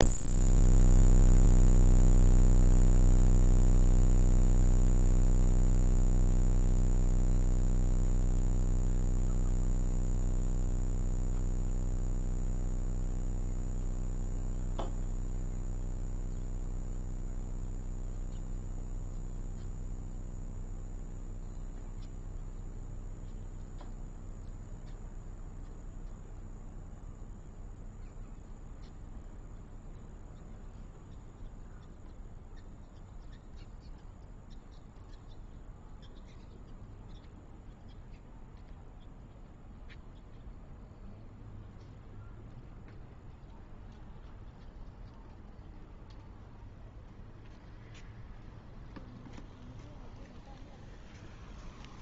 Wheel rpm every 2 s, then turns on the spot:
0, 0, 0, 0, 0, 0, 0, 0, 0, 0, 0, 0, 0, 0, 0, 0, 0, 0, 0, 0, 0, 0, 0, 0, 0, 0.
none